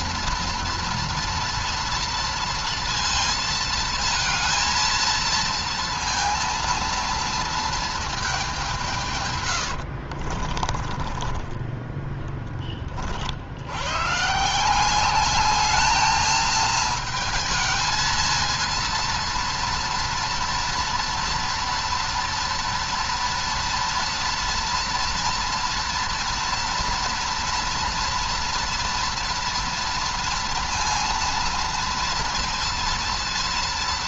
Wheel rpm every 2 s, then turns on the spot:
230, 230, 230, 230, 150, 20, 30, 190, 220, 230, 230, 230, 230, 230, 230, 230, 230.
10-12